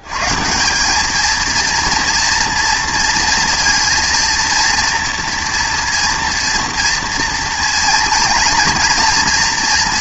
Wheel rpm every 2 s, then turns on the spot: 130, 230, 230, 230, 230.
none